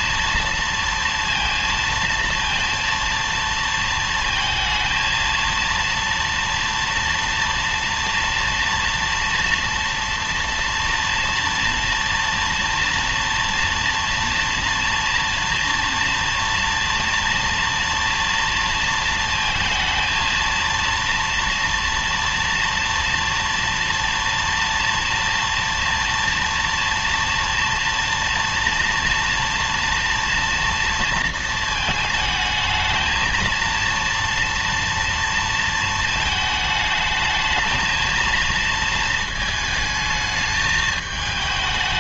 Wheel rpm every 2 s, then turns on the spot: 230, 230, 230, 230, 230, 240, 240, 240, 230, 230, 230, 230, 230, 230, 230, 230, 220, 230, 220, 230, 220.
none